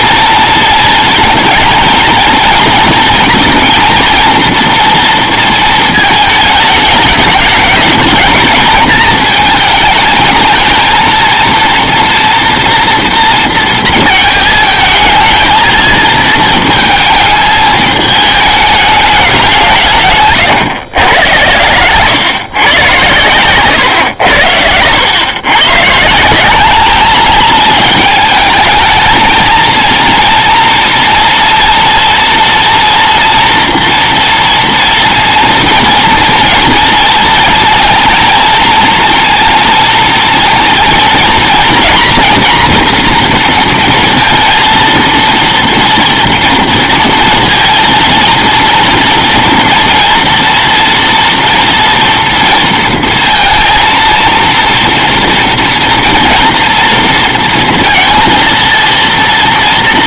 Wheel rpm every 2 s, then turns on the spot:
230, 230, 230, 220, 220, 220, 230, 220, 220, 210, 120, 130, 90, 190, 220, 230, 240, 240, 230, 230, 230, 240, 230, 230, 230, 230, 230, 230, 230, 230.
none